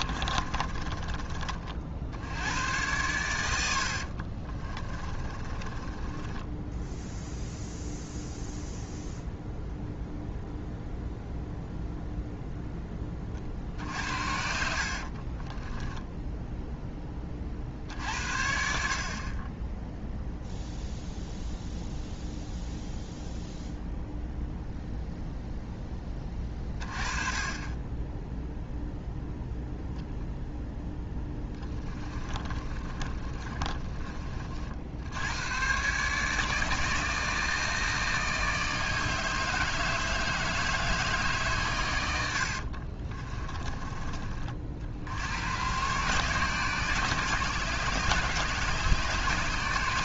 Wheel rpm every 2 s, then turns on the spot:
30, 100, 30, 10, 0, 0, 0, 60, 10, 60, 0, 0, 0, 20, 0, 0, 20, 50, 160, 160, 150, 50, 50, 140, 140.
0-2 4-6 14-16 32-34 42-44